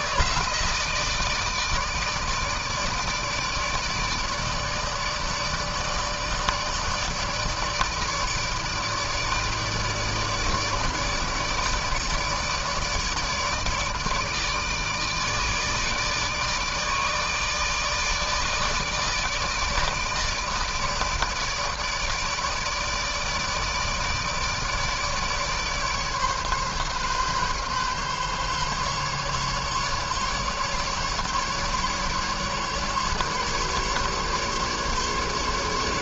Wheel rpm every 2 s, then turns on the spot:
160, 160, 150, 150, 150, 150, 160, 160, 150, 150, 160, 160, 150, 140, 140, 150, 150, 140.
none